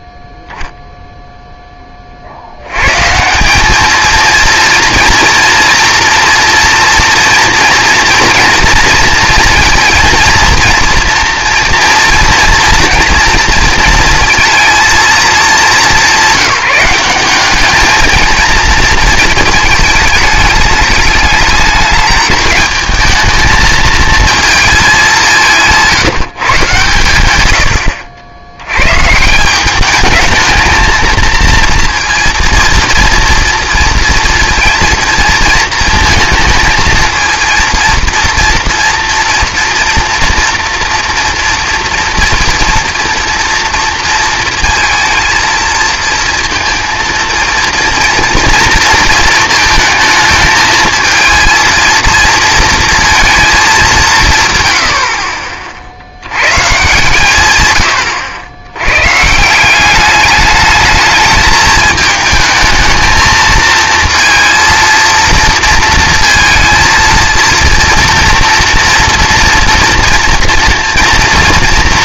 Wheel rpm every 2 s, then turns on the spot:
10, 90, 230, 240, 230, 230, 230, 230, 200, 230, 210, 220, 220, 140, 100, 220, 230, 230, 220, 230, 230, 230, 230, 230, 230, 220, 230, 130, 120, 100, 210, 220, 230, 230, 240, 230.
none